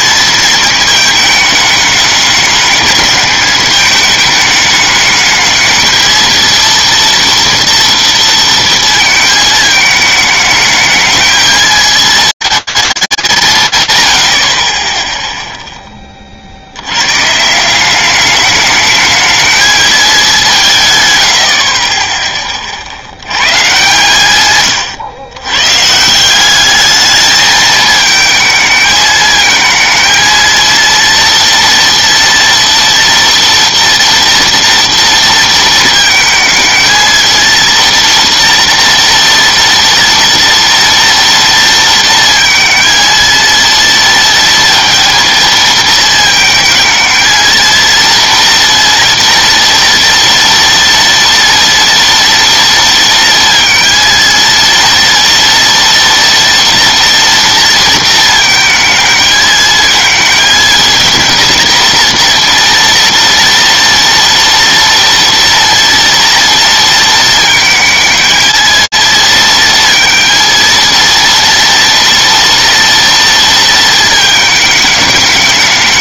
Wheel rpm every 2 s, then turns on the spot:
220, 200, 210, 230, 230, 220, 220, 80, 60, 210, 180, 40, 130, 200, 220, 230, 230, 230, 230, 230, 230, 230, 230, 220, 230, 230, 230, 230, 230, 220, 230, 230, 230, 230, 220, 230, 230, 220.
none